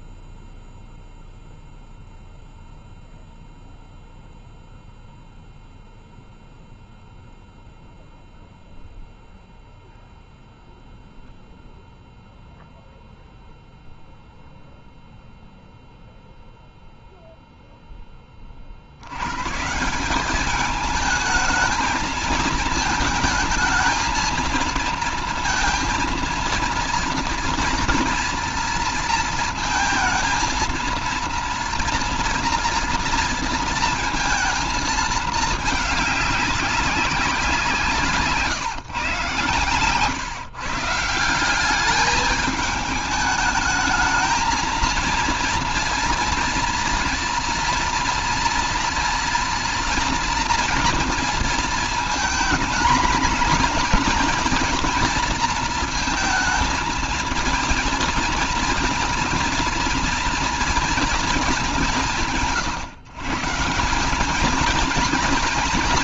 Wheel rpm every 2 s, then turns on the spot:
0, 0, 0, 0, 0, 0, 0, 0, 0, 120, 220, 220, 230, 240, 230, 230, 230, 210, 180, 120, 180, 210, 230, 230, 230, 230, 230, 230, 230, 230, 210, 140, 230.
none